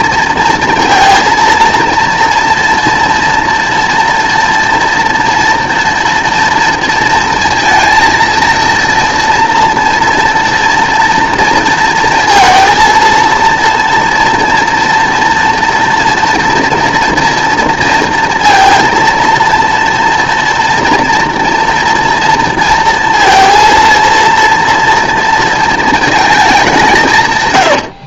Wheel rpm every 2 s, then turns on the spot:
230, 230, 230, 230, 230, 230, 230, 240, 230, 230, 230, 230, 230, 190.
none